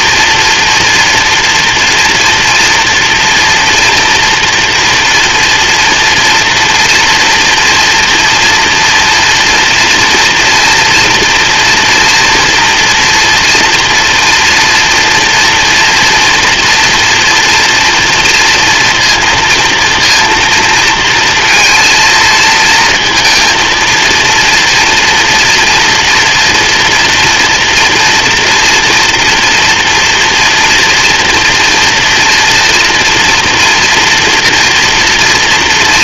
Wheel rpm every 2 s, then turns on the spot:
230, 240, 240, 230, 230, 230, 240, 230, 230, 230, 230, 230, 230, 230, 230, 230, 230, 230.
none